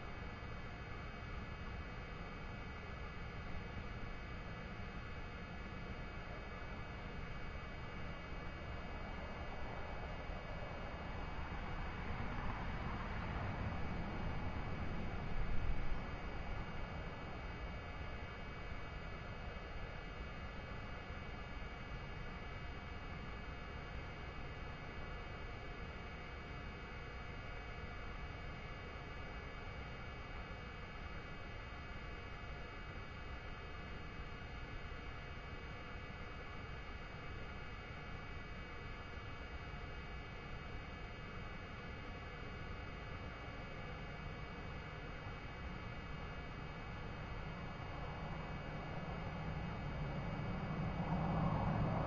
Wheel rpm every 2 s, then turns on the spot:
0, 0, 0, 0, 0, 0, 0, 0, 0, 0, 0, 0, 0, 0, 0, 0, 0, 0, 0, 0, 0, 0, 0, 0, 0, 0.
none